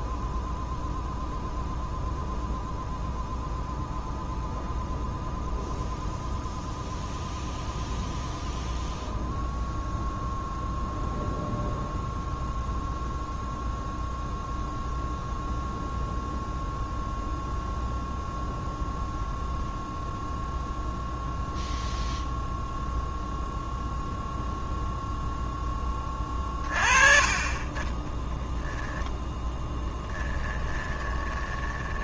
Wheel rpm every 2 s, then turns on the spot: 0, 0, 0, 0, 0, 0, 0, 0, 0, 0, 0, 0, 0, 30, 0, 20.
30-32